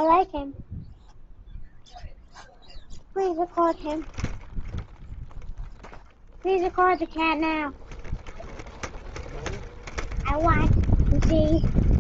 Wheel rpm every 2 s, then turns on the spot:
0, 0, 0, 0, 0, 0.
none